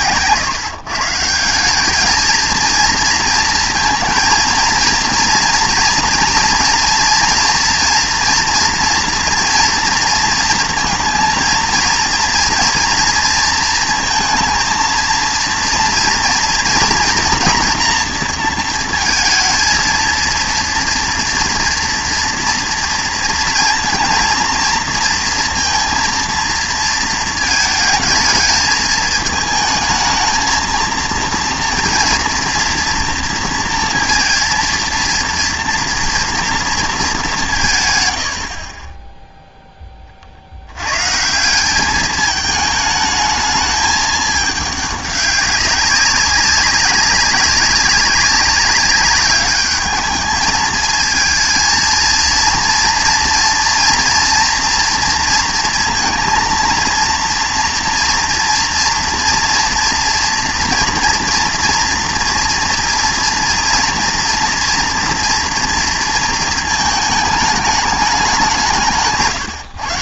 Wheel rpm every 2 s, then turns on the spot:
140, 230, 230, 230, 230, 230, 230, 230, 230, 230, 230, 230, 230, 230, 220, 220, 230, 230, 230, 60, 80, 210, 210, 190, 190, 220, 230, 230, 230, 230, 230, 230, 240, 230, 190.
none